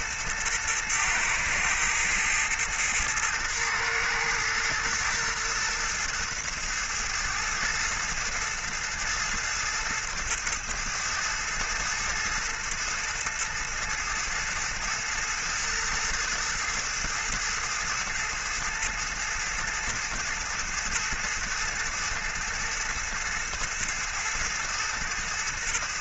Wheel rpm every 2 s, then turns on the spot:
110, 110, 110, 110, 110, 110, 110, 110, 110, 110, 110, 110, 110.
none